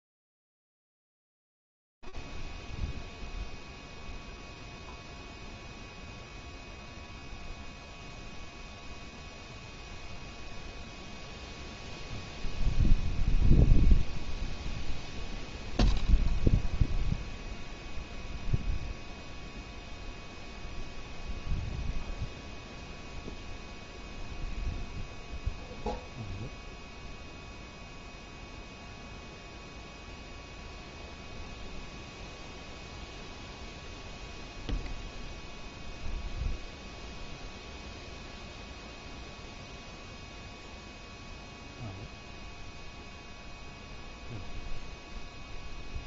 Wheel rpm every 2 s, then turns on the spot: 0, 0, 0, 0, 0, 0, 0, 0, 0, 0, 0, 0, 0, 0, 0, 0, 0, 0, 0, 0, 0, 0, 0.
none